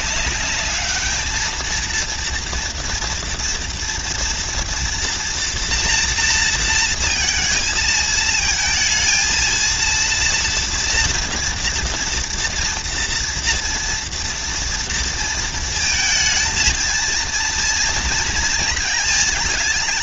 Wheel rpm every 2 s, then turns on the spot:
210, 230, 230, 230, 230, 230, 240, 230, 230, 230.
none